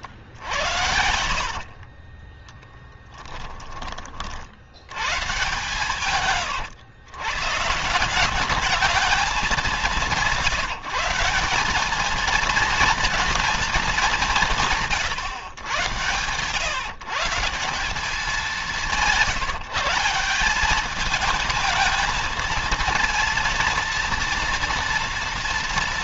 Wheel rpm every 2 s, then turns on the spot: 80, 10, 100, 110, 210, 180, 230, 150, 140, 190, 210, 230, 230.
0-4